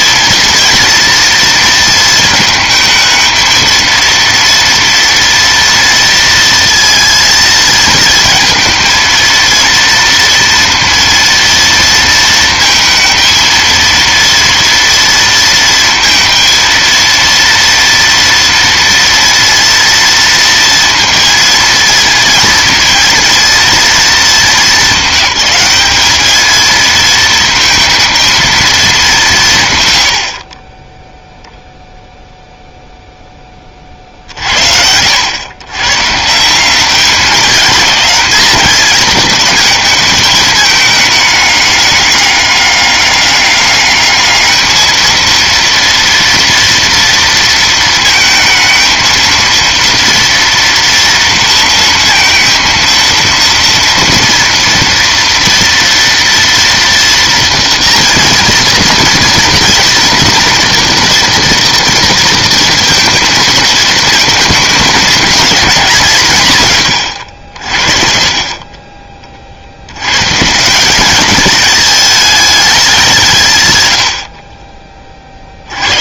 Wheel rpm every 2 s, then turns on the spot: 230, 220, 230, 230, 230, 230, 220, 230, 230, 230, 230, 230, 210, 220, 200, 0, 0, 70, 180, 220, 210, 200, 220, 230, 220, 230, 230, 240, 230, 230, 230, 230, 220, 140, 30, 170, 210, 40.
none